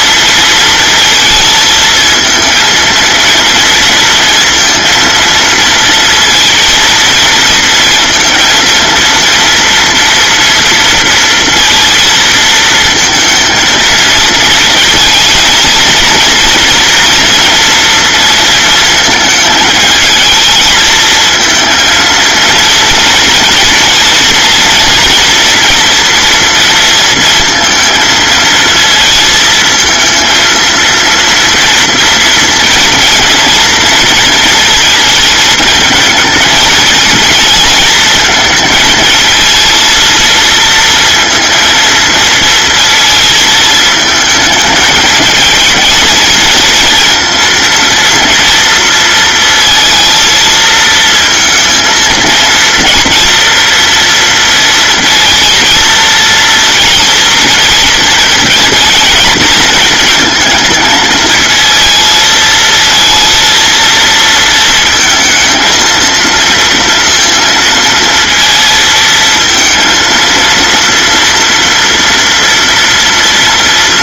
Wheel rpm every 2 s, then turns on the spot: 230, 230, 230, 230, 230, 230, 230, 230, 240, 230, 220, 230, 240, 230, 220, 230, 230, 220, 220, 220, 230, 230, 220, 230, 230, 220, 230, 230, 230, 220, 220, 220, 220, 230, 230, 230, 240.
none